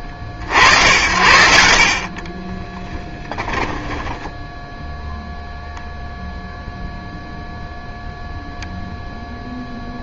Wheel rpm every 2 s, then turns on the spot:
90, 20, 10, 0, 0.
2-6